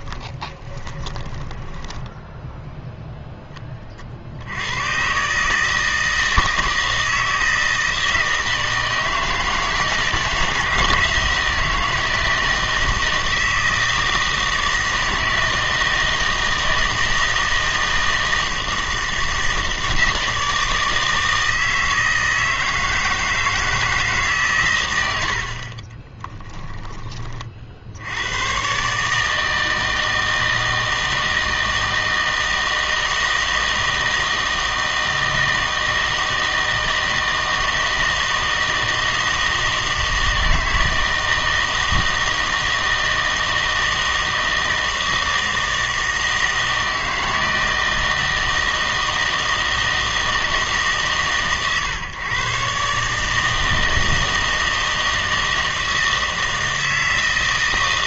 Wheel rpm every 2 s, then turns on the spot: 20, 0, 100, 160, 160, 160, 160, 160, 160, 160, 160, 160, 110, 10, 130, 160, 160, 160, 160, 160, 160, 160, 160, 160, 160, 150, 140, 160, 160.
0-2